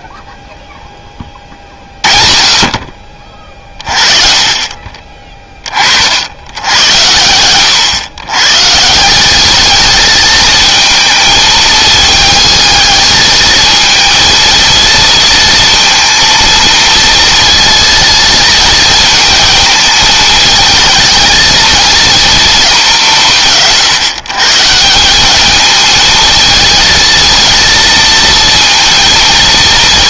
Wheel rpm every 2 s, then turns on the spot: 20, 40, 30, 100, 150, 220, 220, 230, 230, 220, 220, 200, 170, 220, 230.
none